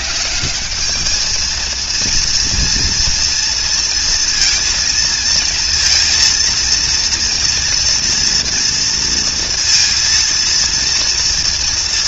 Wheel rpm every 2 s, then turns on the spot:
200, 230, 230, 230, 230, 230.
none